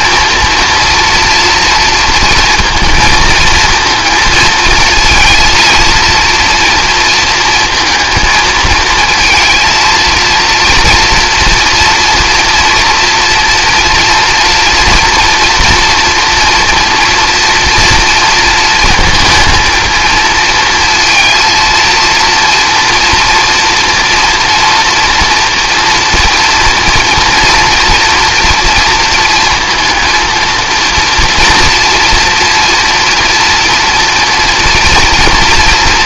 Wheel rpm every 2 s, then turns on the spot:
230, 230, 230, 230, 220, 230, 240, 240, 230, 230, 220, 230, 240, 230, 220, 230, 230, 230.
none